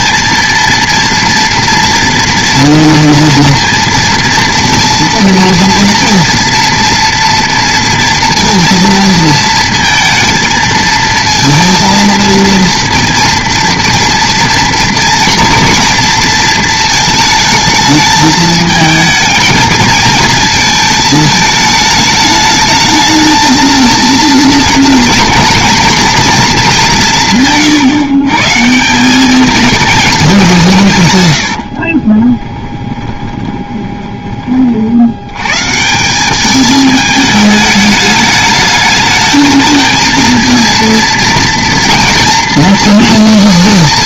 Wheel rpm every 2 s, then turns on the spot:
230, 230, 230, 230, 230, 230, 230, 230, 230, 220, 220, 210, 220, 230, 160, 220, 50, 20, 170, 210, 220, 240.
32-36